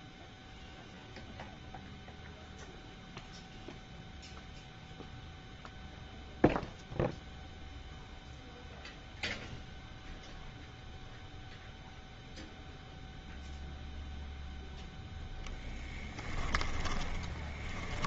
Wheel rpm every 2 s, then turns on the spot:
0, 0, 0, 0, 0, 0, 0, 0, 10.
16-18